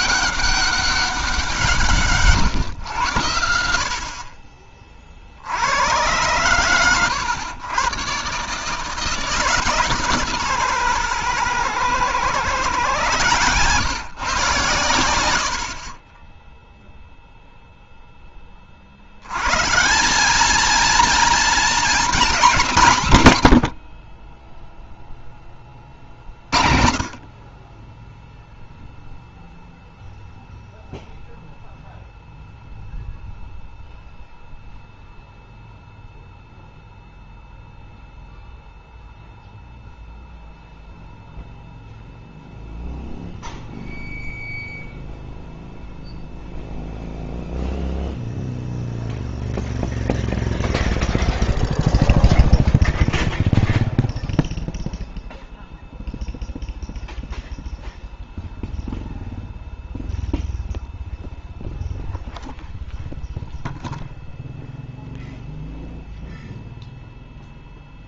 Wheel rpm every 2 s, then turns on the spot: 200, 120, 50, 110, 150, 120, 120, 100, 0, 120, 230, 140, 10, 30, 0, 0, 0, 0, 0, 0, 0, 0, 0, 0, 0, 0, 0, 0, 0, 0, 0, 0, 0, 0.
none